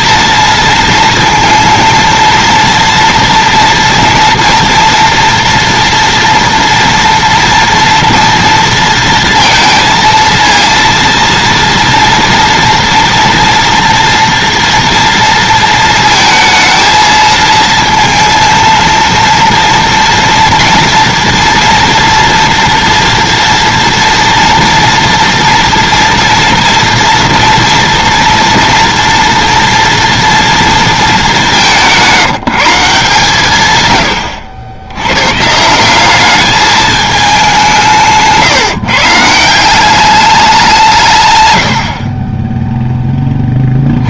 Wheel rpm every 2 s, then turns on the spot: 230, 230, 230, 230, 230, 230, 230, 230, 230, 230, 230, 230, 230, 230, 230, 230, 180, 100, 210, 160, 180, 10.
none